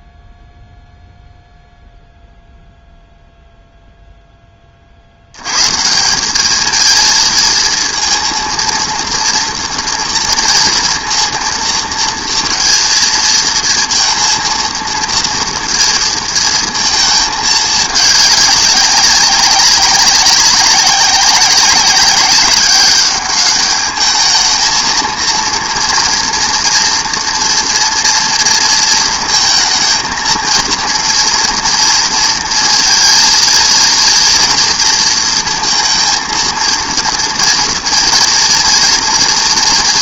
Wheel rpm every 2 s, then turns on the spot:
0, 0, 30, 220, 230, 230, 230, 230, 220, 190, 190, 190, 220, 240, 230, 230, 230, 230, 230, 230.
none